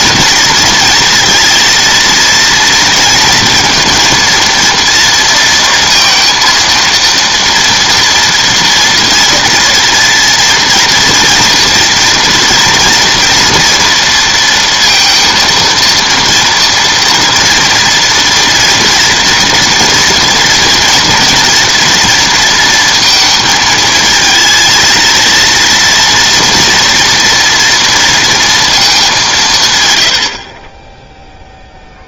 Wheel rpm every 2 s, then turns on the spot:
230, 230, 230, 230, 230, 230, 230, 230, 230, 230, 240, 230, 230, 240, 230, 40.
none